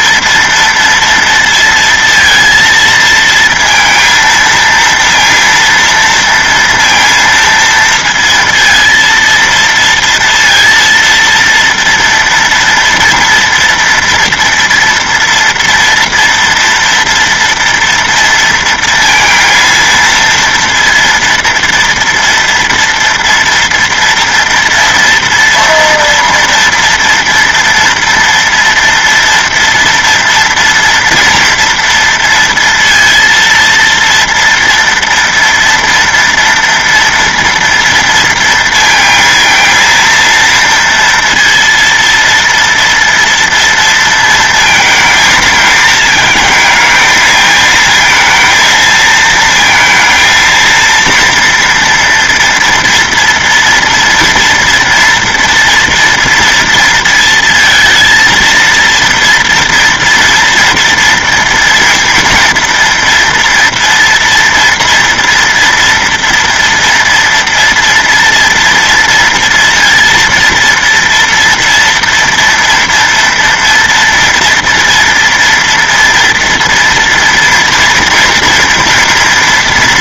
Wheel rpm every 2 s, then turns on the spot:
230, 230, 230, 230, 230, 230, 230, 230, 230, 230, 230, 230, 230, 230, 230, 230, 230, 230, 230, 230, 230, 240, 230, 220, 230, 230, 230, 230, 230, 230, 230, 240, 230, 230, 230, 230, 230, 230, 230, 230.
none